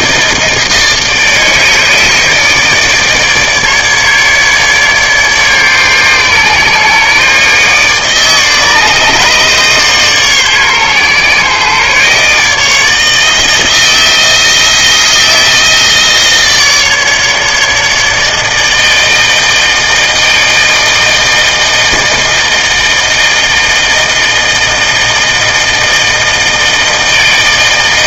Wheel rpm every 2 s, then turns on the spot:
160, 160, 150, 140, 150, 140, 150, 160, 160, 160, 160, 160, 160, 160.
none